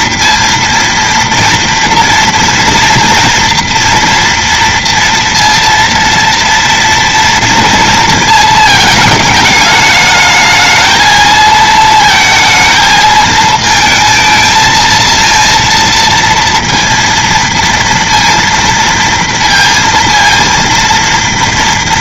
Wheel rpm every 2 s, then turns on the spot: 230, 230, 230, 230, 220, 220, 220, 220, 230, 230, 230.
none